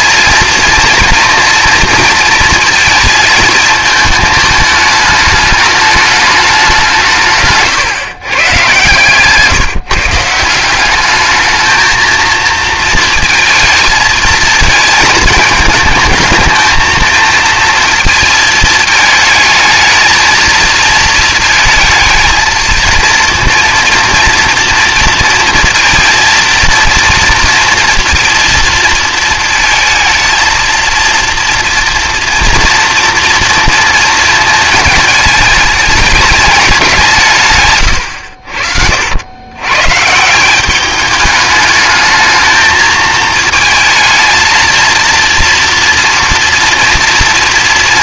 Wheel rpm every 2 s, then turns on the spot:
230, 230, 220, 180, 130, 190, 230, 220, 220, 220, 220, 230, 230, 230, 230, 230, 230, 220, 180, 70, 200, 220, 230, 240.
none